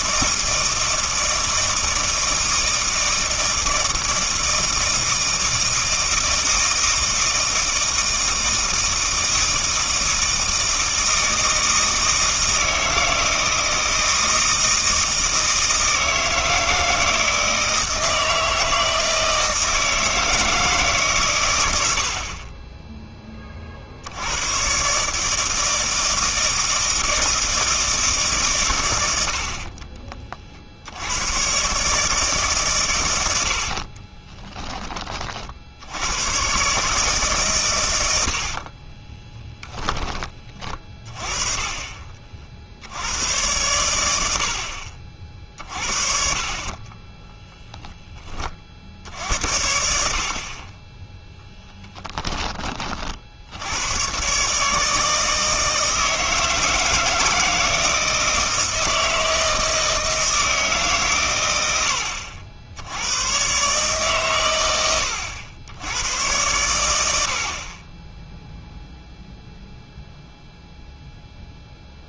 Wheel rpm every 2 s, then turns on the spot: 160, 160, 160, 160, 160, 160, 160, 160, 160, 160, 160, 20, 120, 160, 120, 60, 130, 20, 130, 50, 30, 70, 50, 40, 50, 20, 30, 150, 160, 160, 150, 80, 110, 100, 0, 0.
38-40